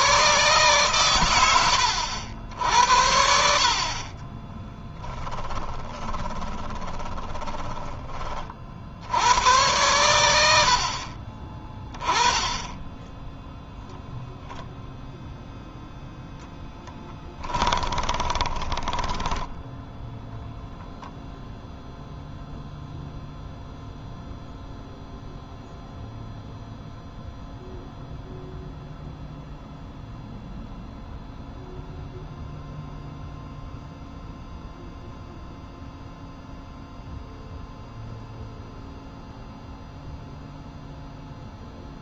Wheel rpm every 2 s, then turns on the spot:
120, 70, 10, 20, 70, 50, 10, 0, 10, 20, 0, 0, 0, 0, 0, 0, 0, 0, 0, 0, 0.
4-8 16-20